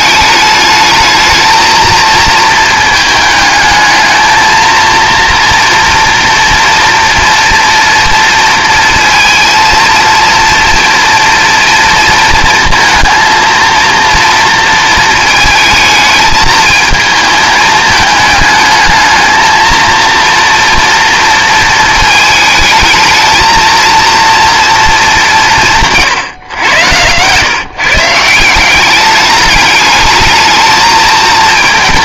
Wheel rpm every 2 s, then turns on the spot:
220, 220, 230, 230, 230, 240, 230, 230, 220, 220, 230, 220, 230, 110, 190, 220.
none